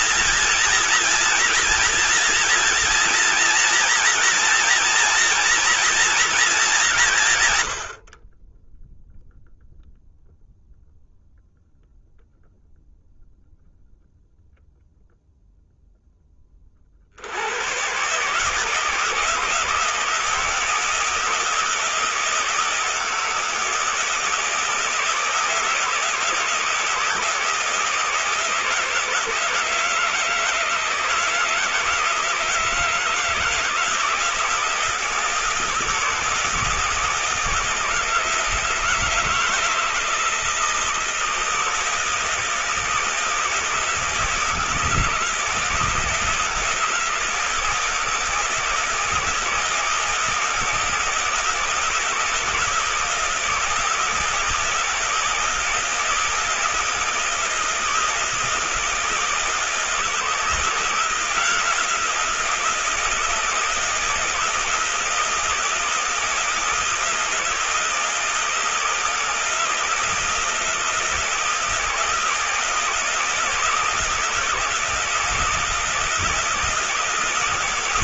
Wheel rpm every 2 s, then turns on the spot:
230, 240, 230, 220, 20, 0, 0, 0, 60, 160, 160, 160, 160, 160, 160, 160, 160, 170, 160, 160, 160, 160, 160, 160, 160, 160, 160, 160, 160, 160, 170, 170, 170, 160, 160, 160, 160, 170, 160.
none